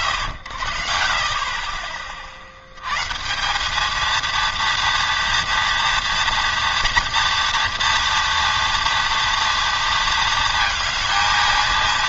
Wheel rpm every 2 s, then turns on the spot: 100, 50, 230, 230, 240, 230.
none